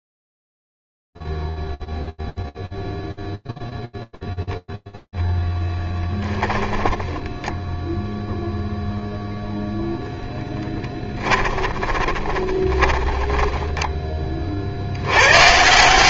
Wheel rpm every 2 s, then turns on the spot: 0, 0, 0, 10, 0, 10, 20, 50.
6-8 10-14